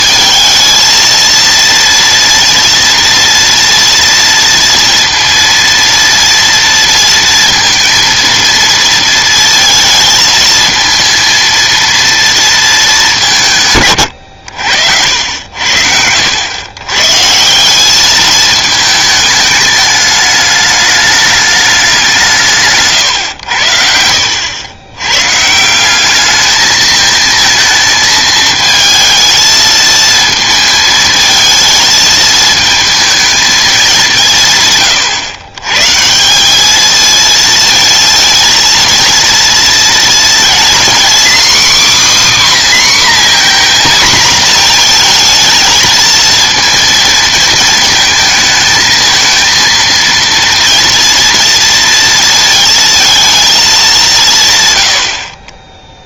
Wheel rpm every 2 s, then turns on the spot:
220, 230, 230, 230, 230, 230, 230, 90, 110, 220, 210, 150, 90, 220, 220, 230, 220, 150, 200, 230, 240, 280, 230, 230, 220, 230, 230, 130.
none